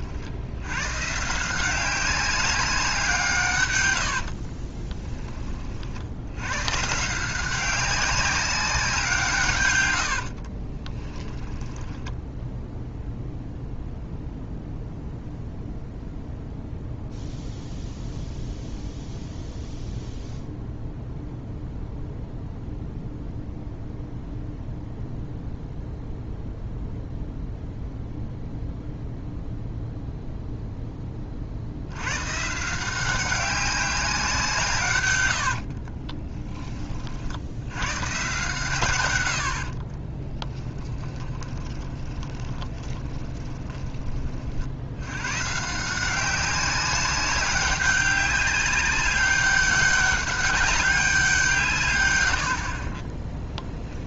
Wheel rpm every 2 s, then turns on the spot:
90, 190, 40, 130, 190, 40, 0, 0, 0, 0, 0, 0, 0, 0, 0, 0, 160, 140, 20, 130, 10, 20, 60, 190, 200, 200, 50.
4-6 10-12 40-44 52-54